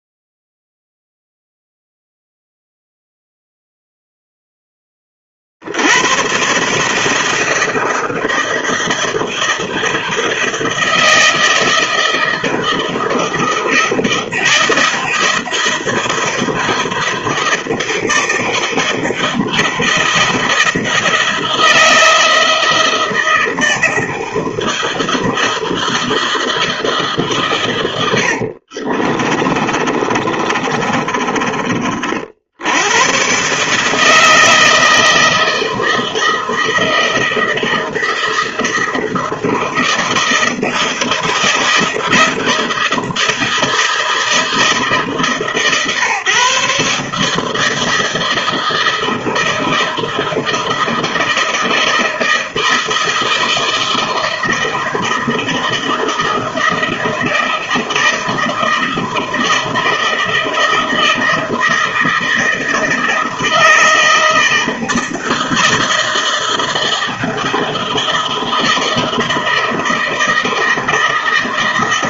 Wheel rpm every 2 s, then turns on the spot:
0, 0, 0, 120, 160, 160, 160, 160, 160, 160, 160, 170, 160, 160, 70, 30, 60, 160, 160, 160, 160, 160, 160, 140, 160, 160, 160, 160, 160, 160, 160, 160, 160, 160, 160, 160.
28-32